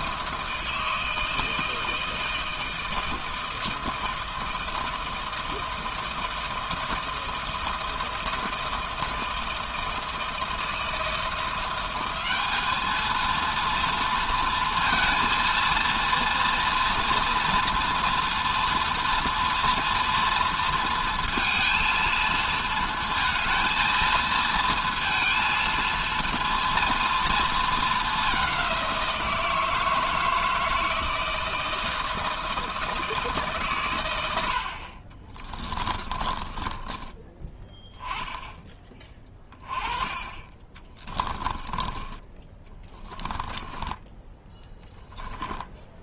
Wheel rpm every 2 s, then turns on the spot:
160, 160, 160, 160, 160, 160, 220, 230, 230, 230, 230, 220, 220, 230, 180, 160, 160, 40, 20, 20, 20, 20, 10.
34-38 40-44